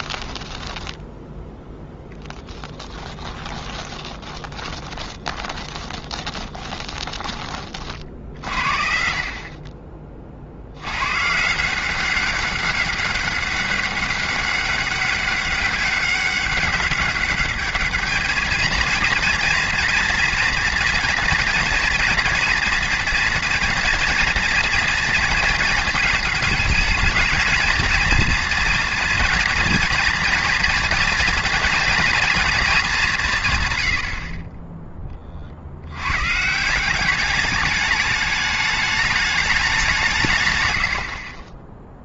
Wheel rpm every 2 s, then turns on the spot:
10, 10, 20, 20, 50, 50, 190, 200, 200, 220, 230, 230, 240, 220, 230, 230, 230, 30, 170, 210, 100.
0-8